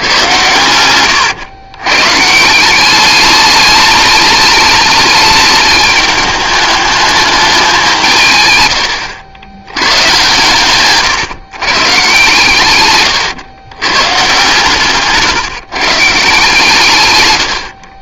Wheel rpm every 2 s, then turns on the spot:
110, 170, 210, 210, 120, 130, 120, 140, 150.
0-2 8-10